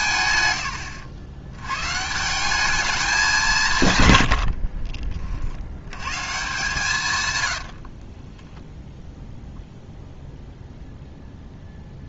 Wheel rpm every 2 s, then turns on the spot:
140, 200, 30, 140, 0, 0.
4-6